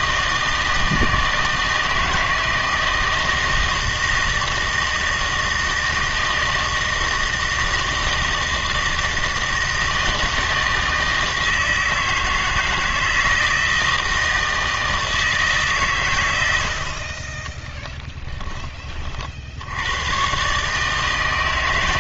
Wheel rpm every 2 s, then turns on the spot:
160, 160, 160, 160, 160, 160, 160, 160, 70, 20, 150.
none